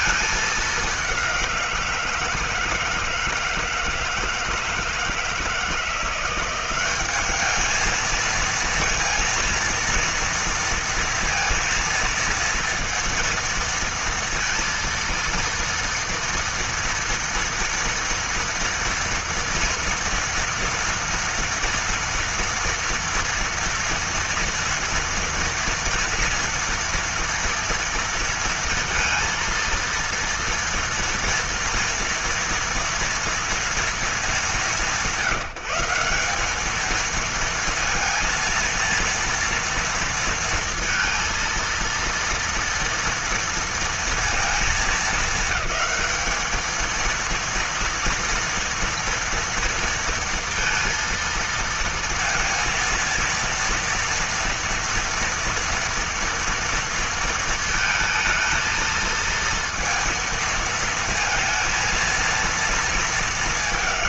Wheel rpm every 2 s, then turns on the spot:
210, 160, 160, 180, 230, 240, 230, 230, 230, 230, 230, 230, 230, 230, 230, 230, 230, 180, 210, 230, 230, 230, 220, 220, 230, 230, 230, 230, 230, 220, 230, 230.
none